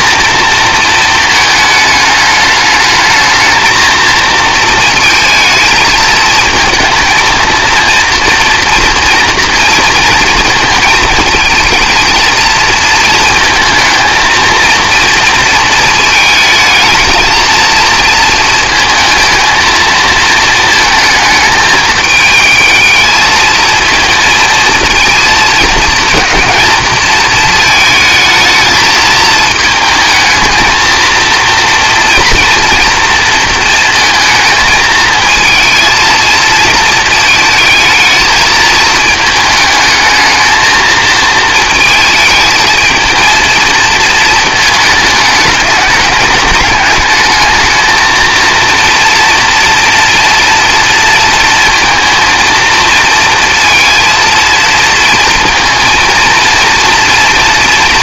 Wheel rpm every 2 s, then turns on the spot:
230, 210, 230, 220, 230, 230, 230, 230, 220, 220, 230, 220, 230, 230, 220, 220, 230, 220, 220, 220, 220, 220, 220, 210, 230, 230, 220, 230, 230.
none